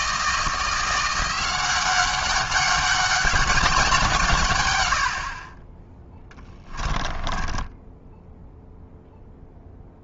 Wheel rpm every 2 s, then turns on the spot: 170, 200, 120, 10, 0.
6-8